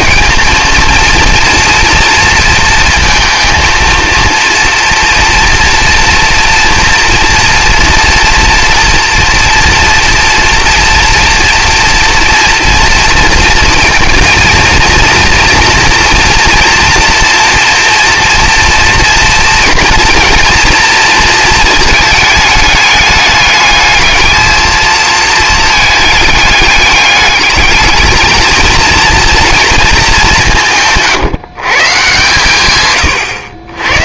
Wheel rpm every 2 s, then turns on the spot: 220, 230, 230, 230, 240, 230, 230, 230, 230, 230, 230, 220, 220, 210, 220, 180, 130.
none